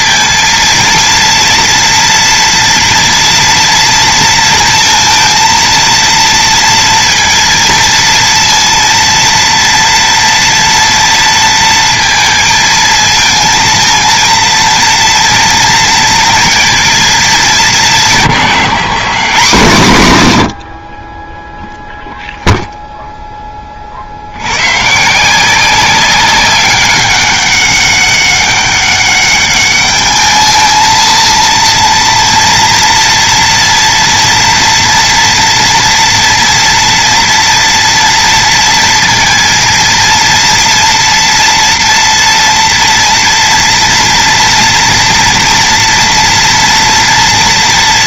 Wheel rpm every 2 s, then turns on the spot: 230, 230, 230, 230, 230, 230, 220, 230, 230, 160, 60, 0, 120, 200, 200, 230, 230, 240, 240, 230, 230, 230, 230, 230.
none